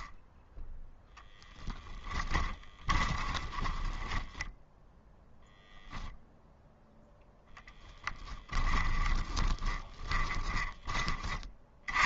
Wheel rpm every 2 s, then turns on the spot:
0, 20, 0, 0, 10, 20.
2-4 8-12